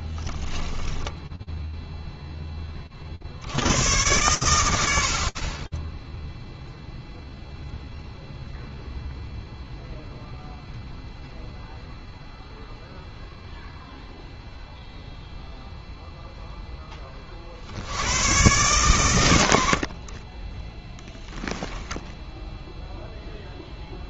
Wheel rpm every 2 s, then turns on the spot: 10, 10, 90, 0, 0, 0, 0, 0, 80, 60, 10, 0.
0-2